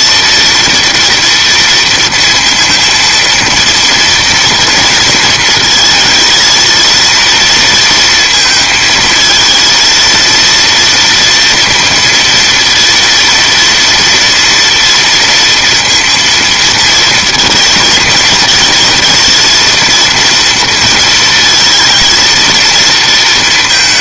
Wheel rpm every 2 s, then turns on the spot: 230, 230, 230, 220, 220, 230, 230, 230, 230, 220, 230, 230.
none